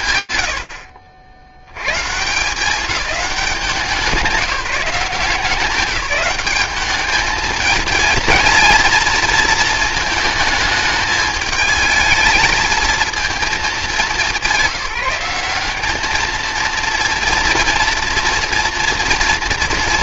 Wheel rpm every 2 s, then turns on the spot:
80, 190, 170, 210, 230, 220, 220, 190, 230, 240.
none